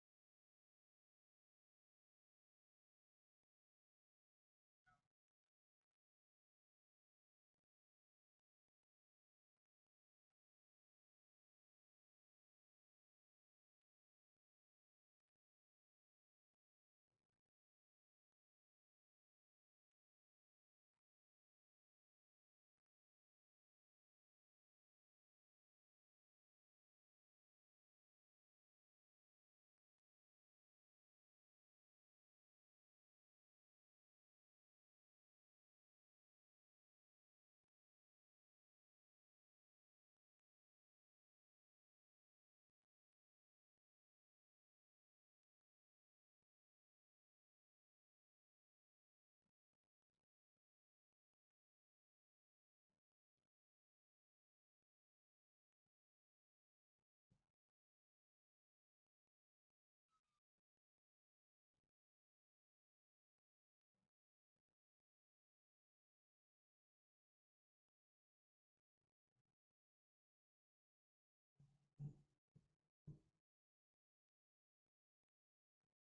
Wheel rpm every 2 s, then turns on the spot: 0, 0, 0, 0, 0, 0, 0, 0, 0, 0, 0, 0, 0, 0, 0, 0, 0, 0, 0, 0, 0, 0, 0, 0, 0, 0, 0, 0, 0, 0, 0, 0, 0, 0, 0, 0, 0, 0.
none